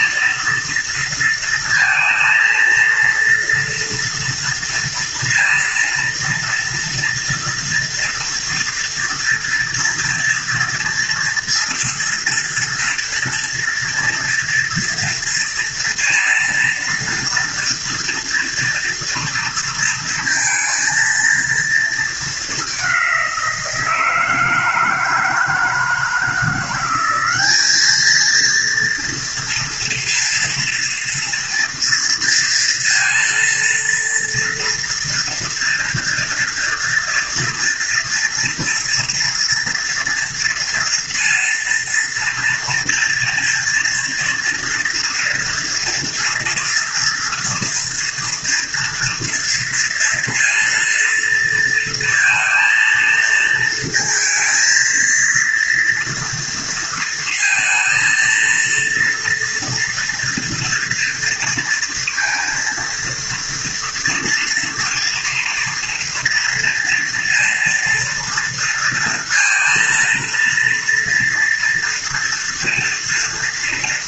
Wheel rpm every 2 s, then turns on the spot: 230, 230, 230, 230, 230, 230, 230, 230, 230, 230, 230, 200, 160, 180, 230, 230, 230, 230, 230, 230, 230, 230, 230, 230, 230, 230, 230, 230, 230, 230, 230, 230, 230, 230, 230, 230, 230.
none